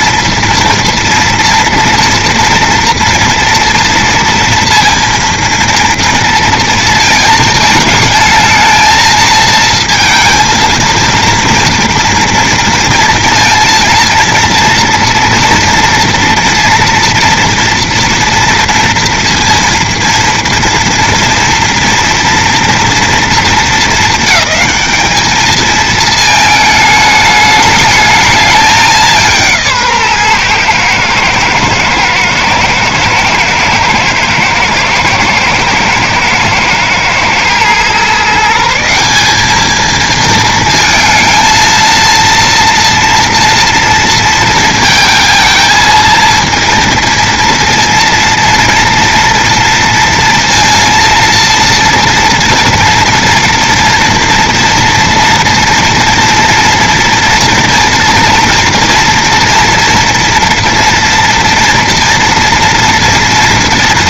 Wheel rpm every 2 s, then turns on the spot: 230, 230, 230, 230, 230, 230, 230, 230, 230, 240, 230, 230, 210, 210, 210, 120, 110, 110, 110, 170, 230, 230, 220, 230, 230, 230, 230, 230, 240, 230, 230, 230.
none